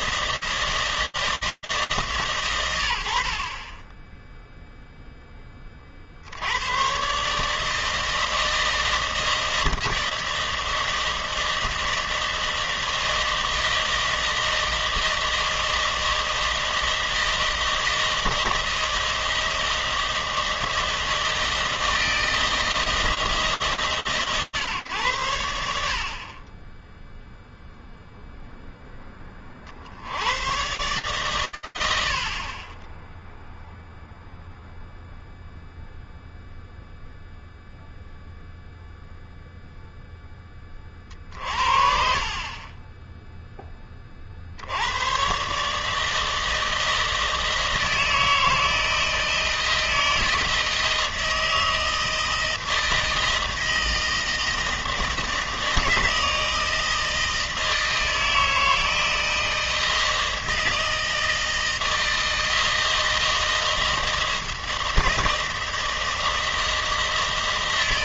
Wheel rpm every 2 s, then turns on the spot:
160, 80, 10, 120, 160, 160, 160, 160, 160, 160, 160, 160, 110, 10, 20, 110, 10, 0, 0, 0, 50, 10, 130, 160, 160, 160, 160, 160, 160, 160, 160, 160, 160, 160.
none